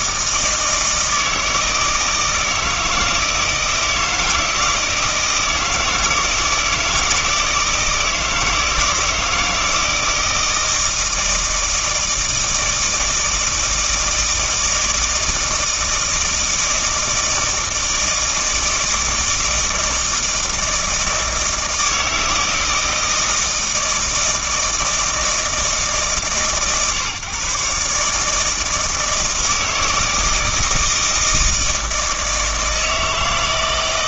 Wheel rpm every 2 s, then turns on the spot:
160, 160, 160, 160, 160, 160, 160, 160, 160, 160, 160, 160, 160, 140, 160, 160, 160.
none